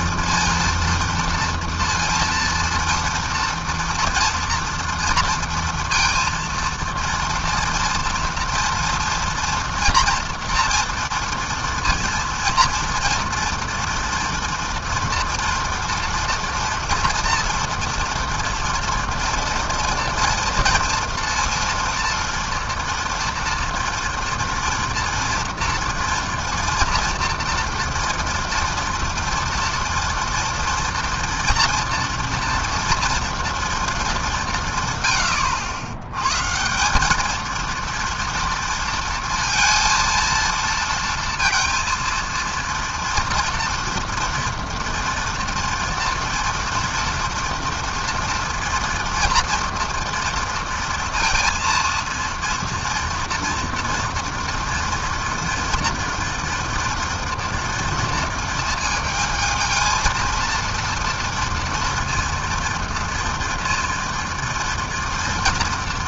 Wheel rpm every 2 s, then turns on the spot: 230, 230, 230, 230, 240, 240, 230, 230, 230, 240, 230, 230, 230, 230, 230, 230, 230, 180, 140, 230, 230, 230, 230, 230, 230, 230, 230, 230, 230, 230, 230, 230, 230.
none